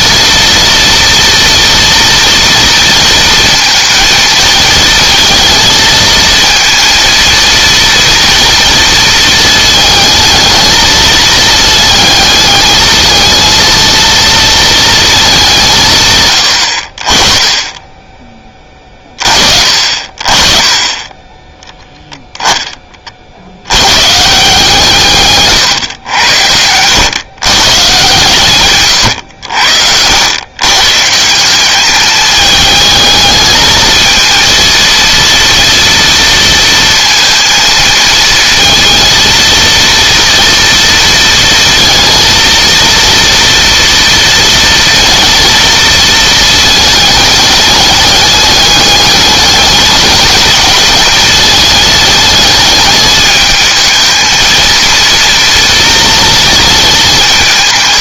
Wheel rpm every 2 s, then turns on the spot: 230, 230, 220, 230, 230, 220, 220, 230, 50, 30, 20, 30, 160, 110, 110, 130, 220, 230, 230, 230, 230, 230, 230, 220, 210, 220, 210, 230, 220.
28-30